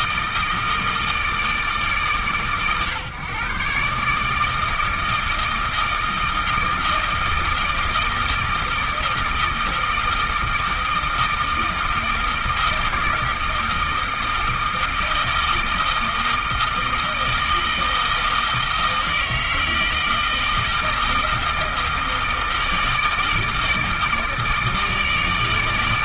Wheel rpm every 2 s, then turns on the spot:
160, 130, 160, 160, 160, 160, 160, 160, 160, 160, 160, 160, 160.
none